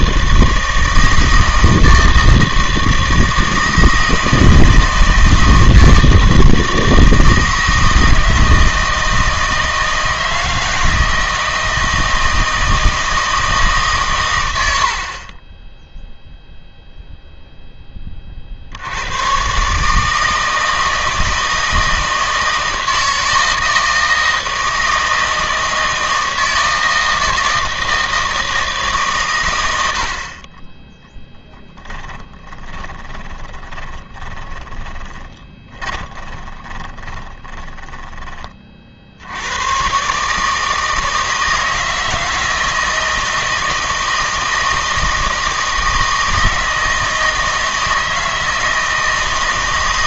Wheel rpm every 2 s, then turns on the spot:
160, 160, 160, 160, 160, 160, 160, 60, 0, 70, 160, 160, 160, 160, 160, 20, 20, 20, 20, 50, 160, 160, 170, 160, 160.
32-38